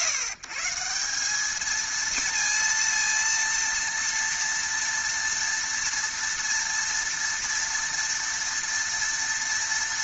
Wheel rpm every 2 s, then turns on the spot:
160, 230, 230, 230, 230.
none